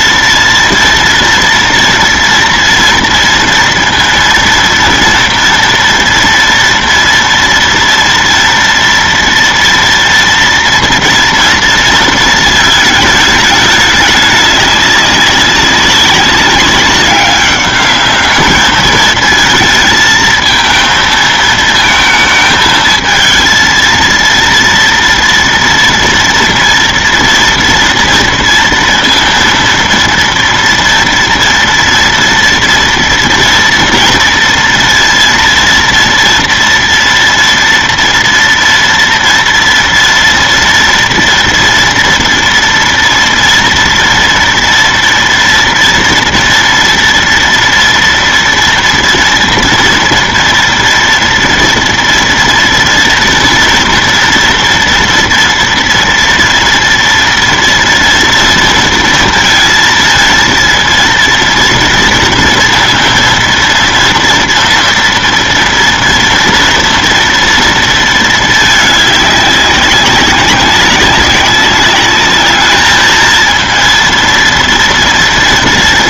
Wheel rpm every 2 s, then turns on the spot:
230, 230, 230, 230, 230, 230, 220, 200, 200, 210, 220, 220, 230, 230, 230, 230, 230, 230, 230, 240, 230, 230, 230, 230, 230, 230, 230, 230, 230, 230, 230, 230, 230, 230, 220, 200, 210, 230.
none